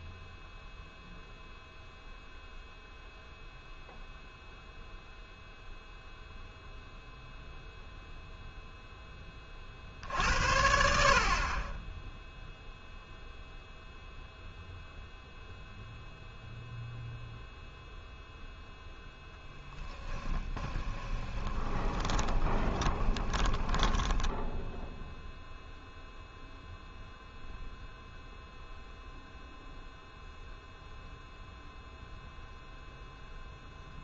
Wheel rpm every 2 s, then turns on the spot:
0, 0, 0, 0, 0, 60, 0, 0, 0, 0, 20, 20, 0, 0, 0, 0, 0.
20-24